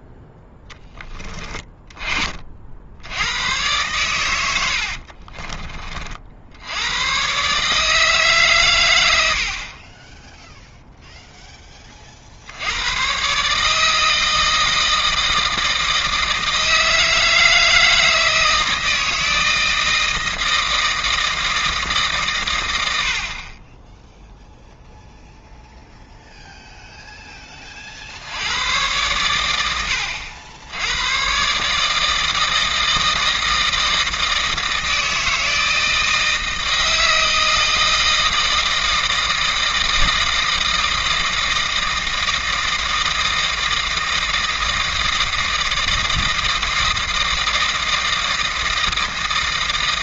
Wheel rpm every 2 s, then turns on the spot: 10, 60, 80, 80, 130, 0, 90, 160, 160, 160, 160, 90, 0, 0, 100, 90, 160, 160, 160, 160, 160, 160, 160, 160, 160.
4-6